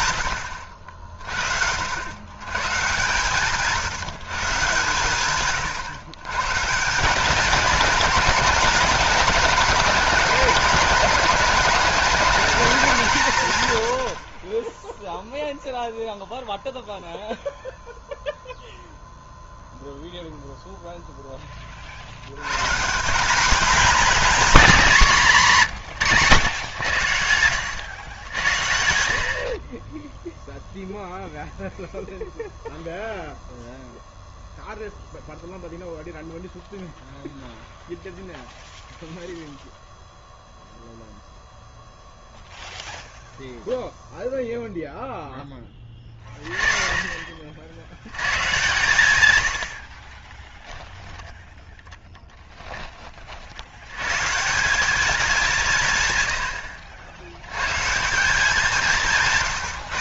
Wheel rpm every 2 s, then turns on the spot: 80, 130, 150, 140, 210, 230, 220, 10, 0, 0, 0, 140, 220, 110, 70, 0, 0, 0, 0, 0, 0, 0, 0, 30, 130, 10, 10, 180, 70, 180.
50-52